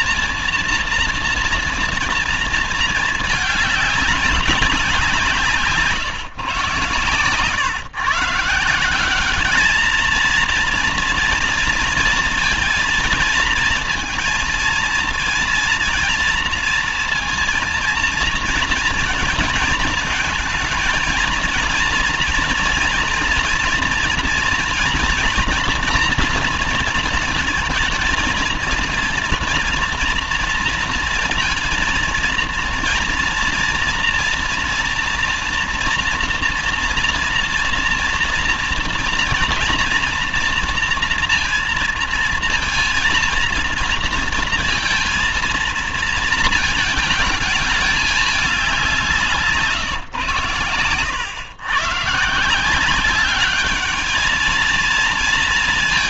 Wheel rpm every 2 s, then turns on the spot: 230, 220, 190, 120, 170, 230, 230, 230, 230, 230, 220, 230, 230, 230, 220, 230, 230, 230, 230, 230, 230, 230, 230, 230, 200, 110, 160, 220.
none